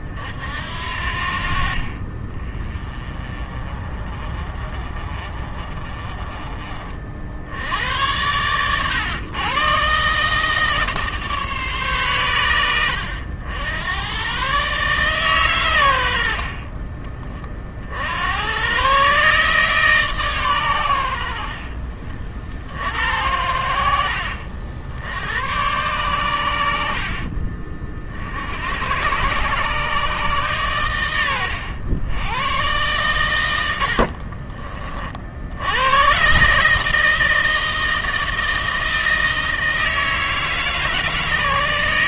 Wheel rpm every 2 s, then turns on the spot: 60, 20, 30, 50, 110, 150, 100, 140, 30, 130, 90, 80, 70, 70, 110, 120, 110, 40, 160, 160, 150.
16-18